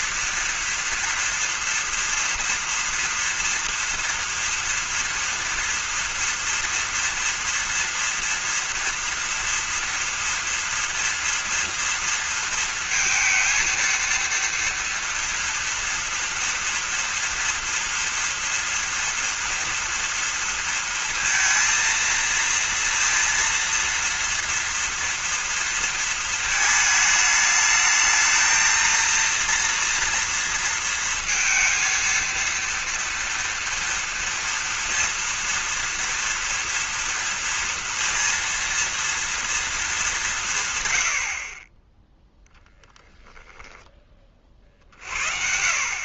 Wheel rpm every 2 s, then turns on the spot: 240, 230, 230, 230, 230, 230, 230, 230, 230, 230, 230, 230, 230, 220, 220, 230, 230, 230, 230, 230, 190, 0, 40.
none